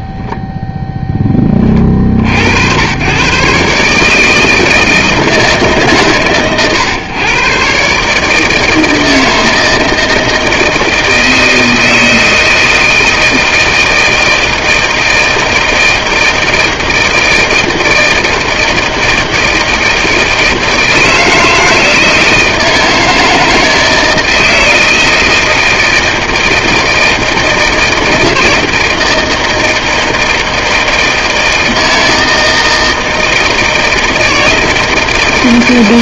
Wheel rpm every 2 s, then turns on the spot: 0, 100, 160, 120, 160, 160, 160, 160, 160, 160, 160, 160, 160, 160, 160, 160, 160, 160.
none